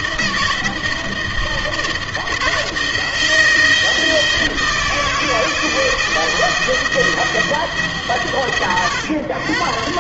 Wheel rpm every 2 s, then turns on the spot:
160, 160, 160, 160, 120.
none